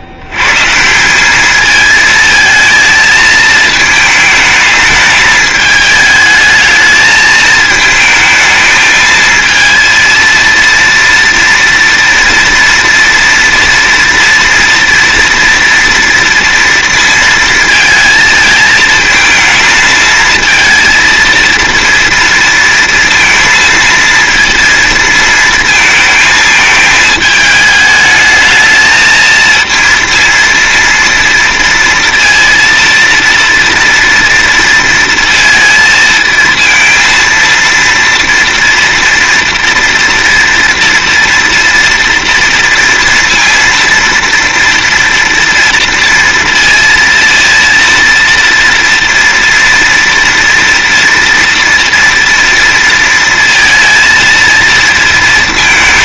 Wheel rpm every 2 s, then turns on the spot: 100, 220, 220, 220, 220, 230, 230, 230, 230, 220, 220, 230, 230, 220, 220, 230, 230, 230, 230, 230, 230, 230, 230, 230, 230, 230, 230, 230.
none